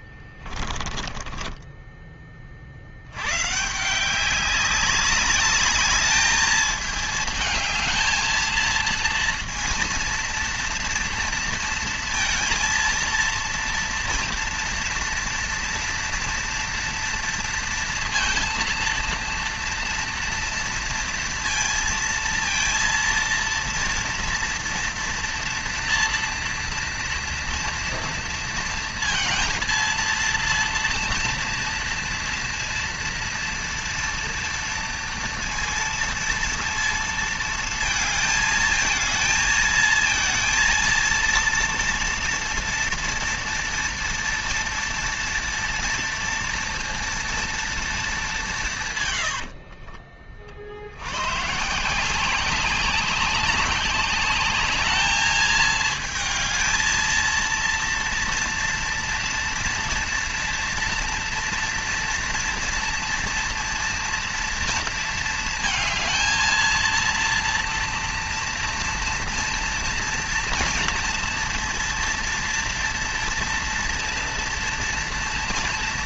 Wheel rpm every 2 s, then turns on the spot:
20, 120, 200, 220, 230, 230, 230, 230, 230, 230, 230, 230, 230, 230, 230, 230, 230, 230, 230, 220, 230, 230, 230, 230, 140, 70, 190, 210, 230, 230, 230, 230, 230, 230, 230, 230, 230, 230.
0-2